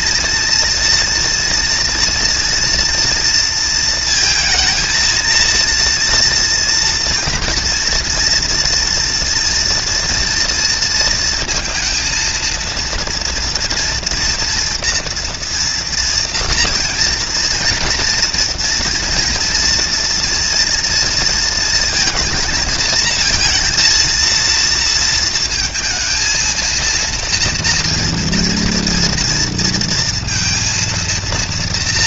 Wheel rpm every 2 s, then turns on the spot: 230, 230, 230, 230, 230, 230, 230, 240, 230, 230, 230, 220, 230, 230, 230, 230.
none